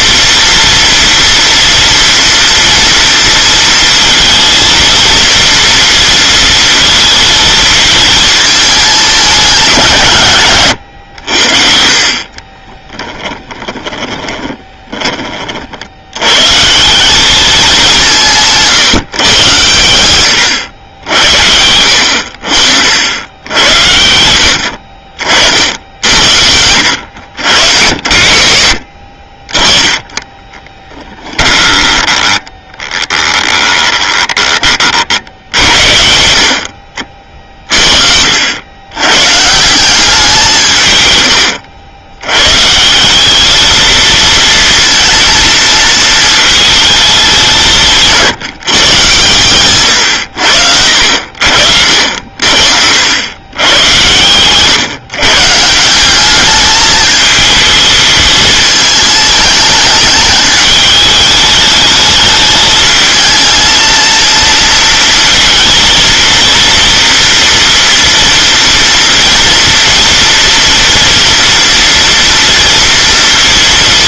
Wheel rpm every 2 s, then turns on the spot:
230, 230, 230, 230, 220, 130, 20, 10, 140, 160, 100, 60, 70, 70, 60, 20, 10, 30, 60, 80, 150, 140, 230, 220, 150, 80, 60, 140, 210, 220, 210, 220, 230, 230, 240, 230, 230.
12-16 30-34